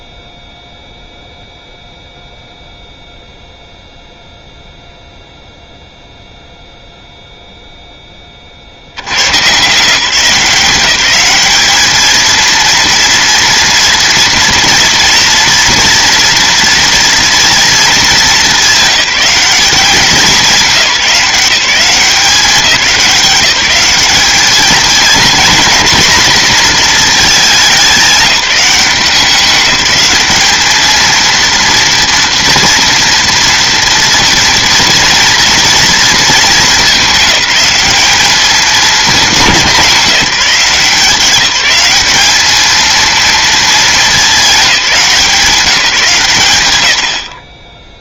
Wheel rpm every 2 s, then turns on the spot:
0, 0, 0, 0, 70, 180, 230, 230, 230, 200, 180, 180, 220, 230, 190, 220, 240, 230, 210, 210, 180, 220, 190, 110.
none